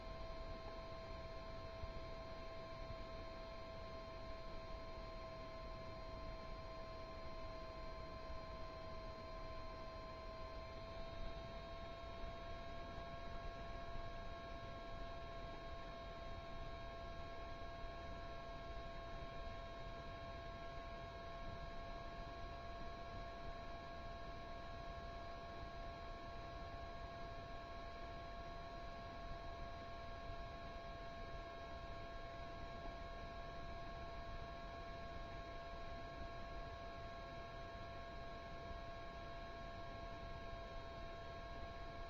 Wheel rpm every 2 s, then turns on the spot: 0, 0, 0, 0, 0, 0, 0, 0, 0, 0, 0, 0, 0, 0, 0, 0, 0, 0, 0, 0, 0.
none